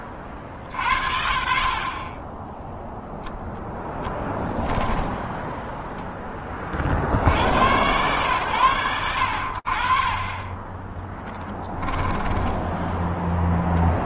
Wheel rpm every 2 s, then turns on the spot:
60, 20, 10, 10, 110, 20, 10.
4-6 12-14